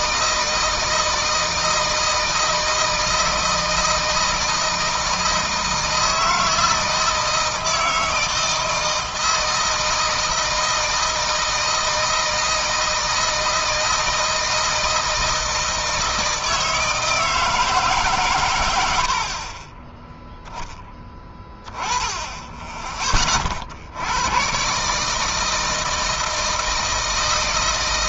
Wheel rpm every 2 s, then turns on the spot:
160, 160, 160, 160, 160, 160, 160, 160, 160, 130, 10, 20, 120, 160.
none